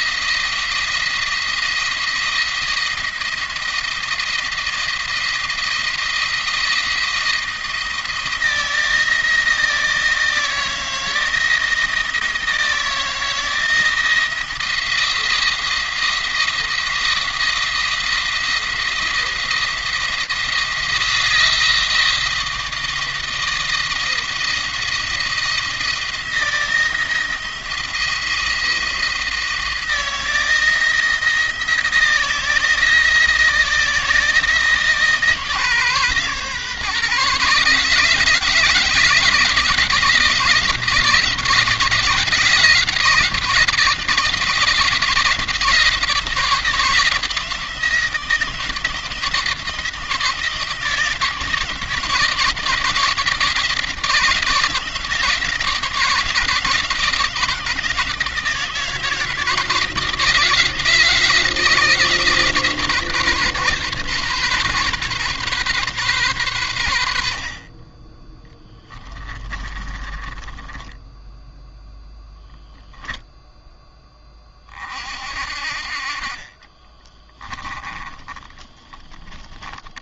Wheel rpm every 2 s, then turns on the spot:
170, 170, 170, 170, 160, 160, 170, 170, 170, 170, 170, 170, 170, 170, 170, 170, 160, 160, 140, 160, 170, 170, 170, 170, 160, 160, 160, 170, 160, 160, 160, 150, 140, 90, 20, 10, 0, 40, 30, 10.
68-70 76-78